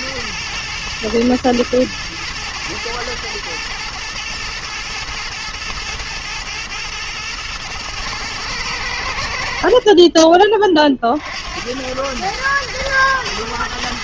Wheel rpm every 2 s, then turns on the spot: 120, 110, 110, 110, 100, 30, 110.
none